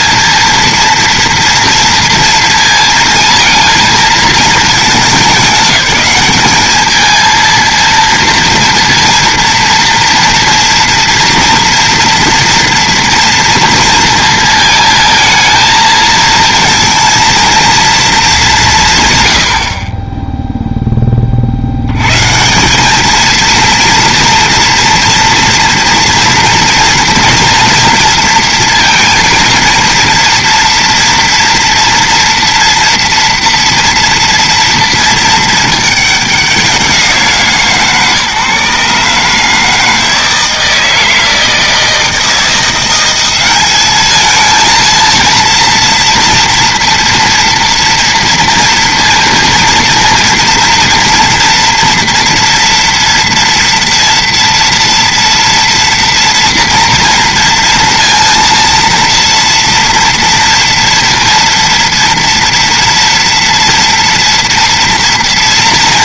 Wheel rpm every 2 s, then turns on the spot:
230, 220, 220, 220, 230, 230, 230, 230, 230, 150, 0, 180, 230, 240, 230, 230, 240, 230, 180, 140, 160, 180, 230, 230, 230, 230, 230, 230, 240, 230, 230, 230, 230.
none